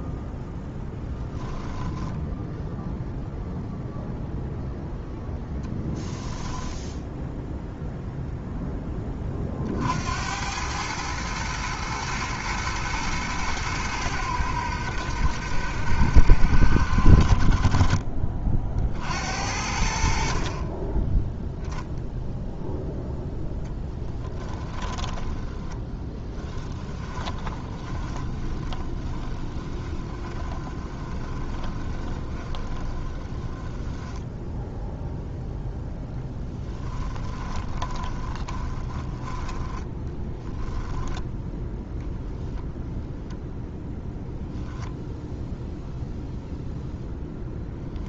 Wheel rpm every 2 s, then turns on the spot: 0, 0, 0, 0, 10, 110, 110, 80, 70, 60, 20, 0, 30, 20, 20, 20, 10, 0, 10, 20, 10, 0, 0, 0.
24-34 36-42